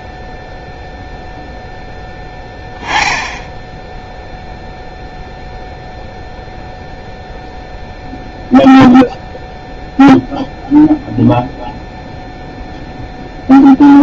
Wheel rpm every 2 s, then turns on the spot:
0, 10, 0, 0, 0, 0, 0.
none